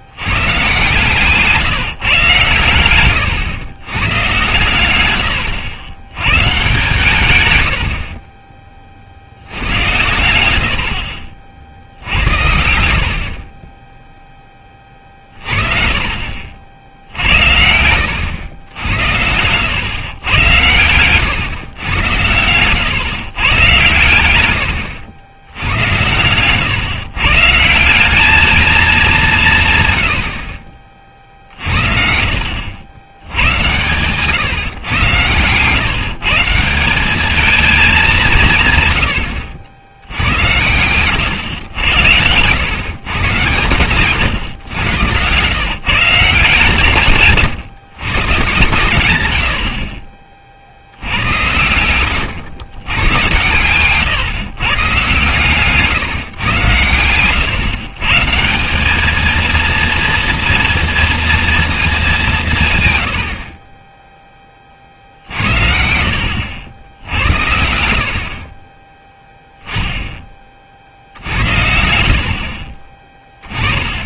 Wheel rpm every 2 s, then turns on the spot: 120, 120, 110, 140, 20, 70, 80, 20, 60, 90, 130, 110, 100, 130, 210, 40, 70, 130, 170, 140, 100, 120, 110, 150, 120, 60, 100, 140, 110, 180, 240, 140, 20, 70, 30, 40, 30.
16-18 40-42 72-74